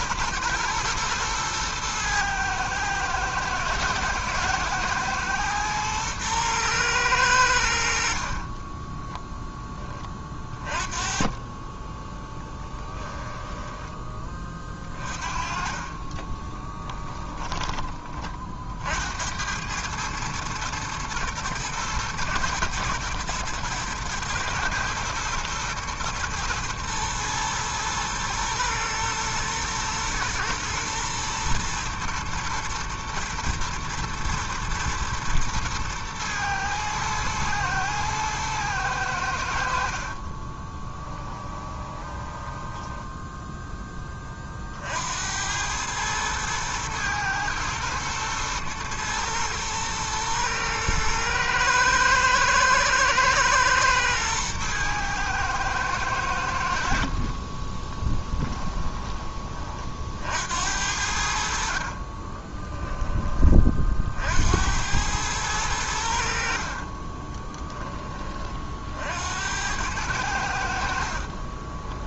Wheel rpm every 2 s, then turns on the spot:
110, 110, 120, 110, 20, 30, 10, 30, 20, 50, 110, 110, 110, 120, 120, 110, 120, 120, 110, 110, 20, 10, 40, 110, 110, 110, 110, 110, 80, 10, 70, 20, 80, 50, 50, 90.
8-10 12-18 40-44 58-60 62-64 66-68